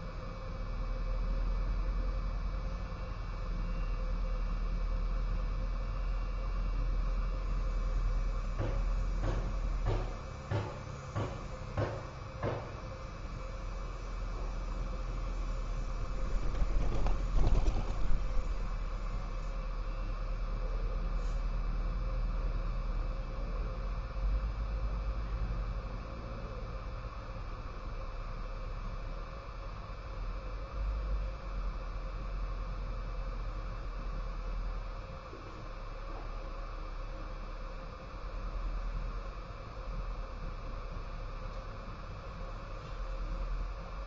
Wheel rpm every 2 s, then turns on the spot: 0, 0, 0, 0, 0, 0, 0, 0, 0, 0, 0, 0, 0, 0, 0, 0, 0, 0, 0, 0, 0, 0.
none